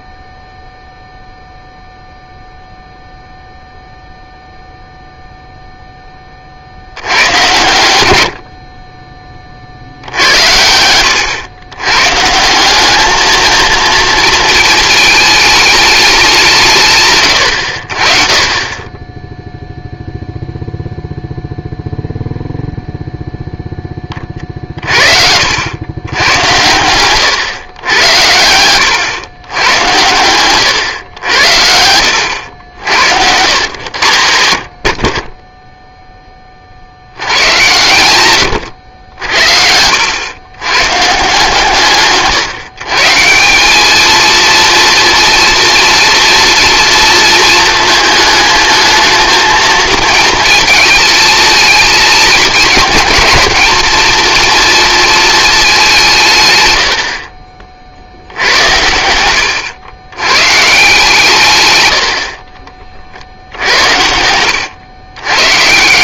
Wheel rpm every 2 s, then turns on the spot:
0, 0, 0, 60, 40, 90, 190, 220, 160, 20, 0, 0, 40, 100, 100, 110, 80, 70, 50, 100, 120, 140, 230, 230, 220, 220, 220, 230, 110, 90, 140, 40, 100.
34-36 38-40